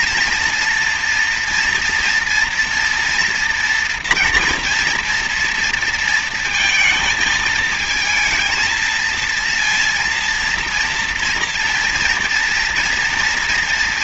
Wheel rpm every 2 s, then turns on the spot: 230, 240, 240, 230, 230, 230, 230.
none